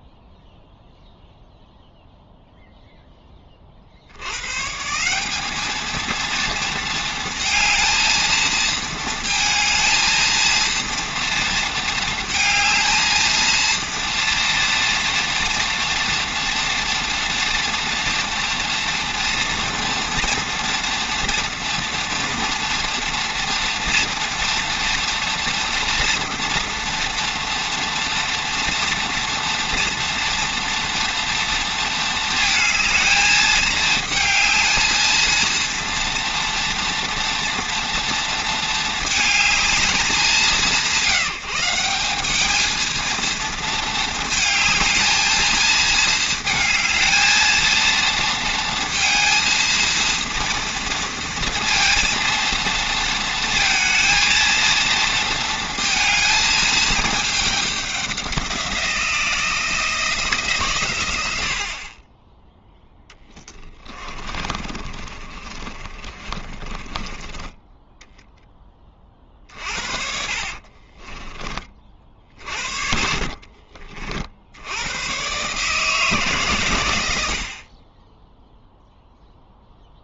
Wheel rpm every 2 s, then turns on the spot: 0, 0, 130, 230, 230, 230, 220, 230, 230, 230, 230, 230, 230, 230, 230, 230, 220, 220, 240, 220, 180, 220, 220, 220, 230, 230, 230, 230, 220, 180, 150, 10, 30, 30, 10, 40, 50, 90, 120, 0.
62-68 70-74